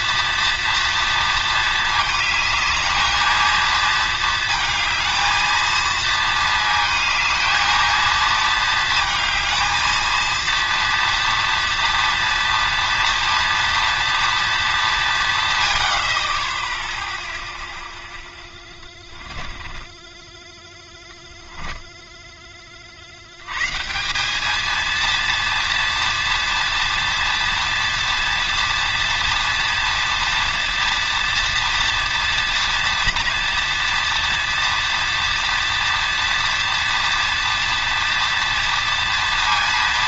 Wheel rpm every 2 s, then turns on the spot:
230, 220, 220, 230, 220, 230, 230, 210, 10, 10, 10, 30, 220, 230, 230, 230, 240, 230, 240, 240.
18-20